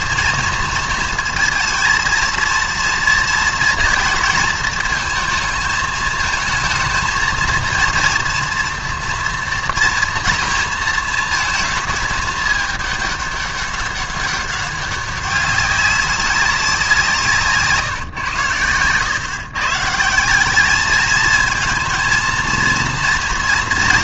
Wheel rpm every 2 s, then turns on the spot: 230, 230, 220, 230, 230, 230, 210, 200, 190, 110, 200, 230.
18-20